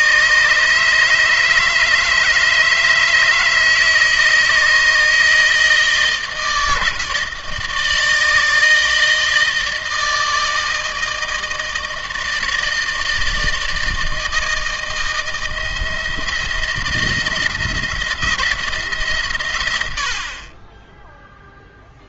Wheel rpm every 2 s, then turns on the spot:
150, 160, 160, 160, 160, 160, 160, 160, 160, 160, 30.
none